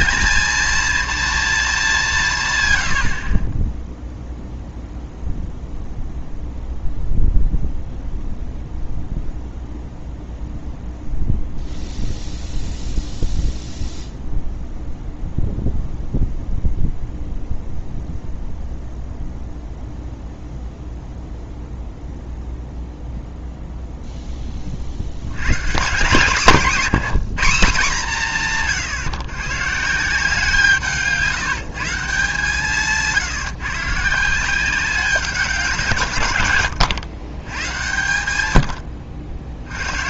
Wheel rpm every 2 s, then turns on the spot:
230, 110, 0, 0, 0, 0, 0, 0, 0, 0, 0, 0, 30, 200, 150, 160, 160, 180, 110, 100.
26-28